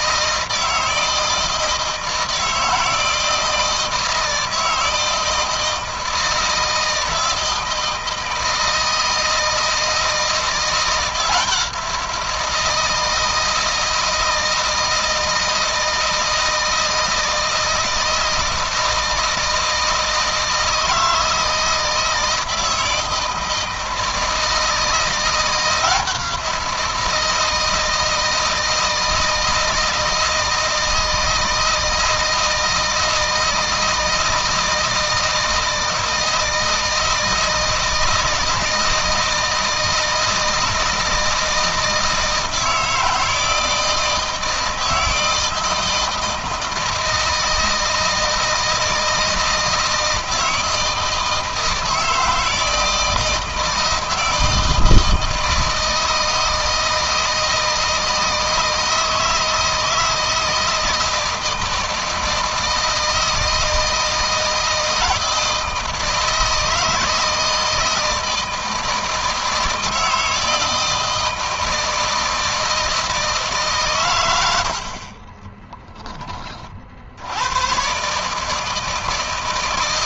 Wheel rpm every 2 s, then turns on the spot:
160, 160, 160, 160, 160, 170, 170, 160, 160, 160, 160, 160, 170, 170, 160, 160, 160, 160, 160, 160, 160, 160, 160, 160, 160, 160, 170, 160, 160, 160, 160, 160, 160, 160, 160, 160, 160, 80, 40, 160.
74-76